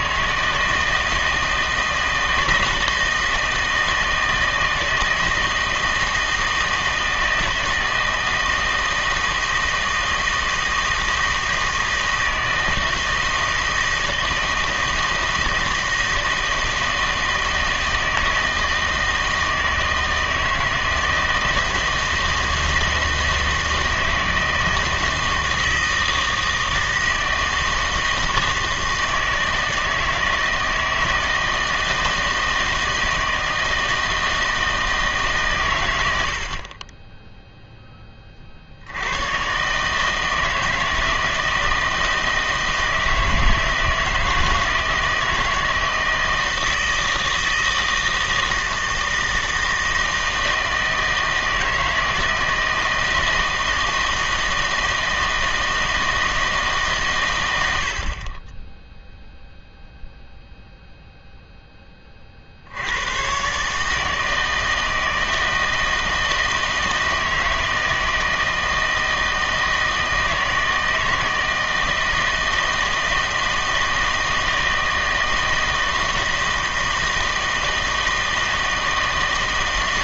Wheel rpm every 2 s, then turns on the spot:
160, 160, 160, 160, 160, 160, 160, 160, 160, 160, 160, 160, 160, 160, 160, 160, 160, 160, 40, 60, 160, 160, 160, 160, 160, 160, 160, 160, 150, 10, 0, 60, 160, 160, 160, 160, 160, 160, 170, 160.
none